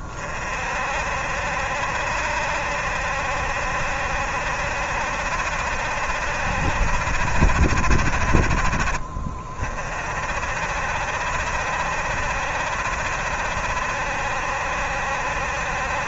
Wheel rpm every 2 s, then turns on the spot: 40, 70, 70, 70, 40, 60, 70, 70.
none